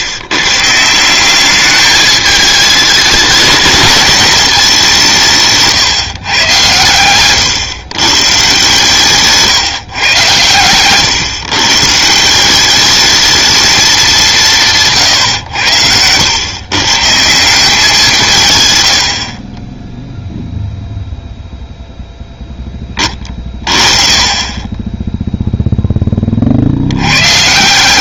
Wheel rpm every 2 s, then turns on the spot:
150, 210, 210, 130, 140, 120, 180, 170, 130, 110, 0, 10, 20, 60.
none